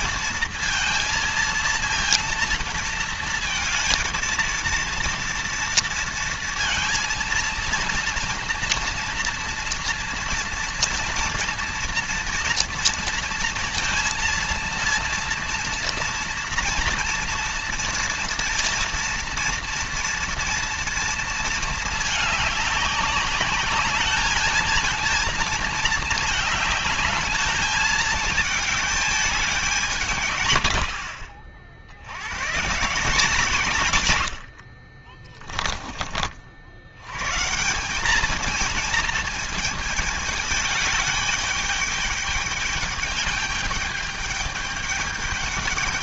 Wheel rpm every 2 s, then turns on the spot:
230, 230, 230, 230, 230, 230, 230, 230, 230, 230, 230, 200, 220, 220, 210, 60, 150, 50, 90, 220, 210, 210, 210.
34-36